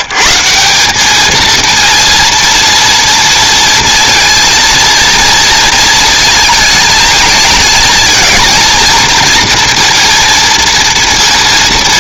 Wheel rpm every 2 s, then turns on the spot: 130, 230, 230, 220, 230, 230.
none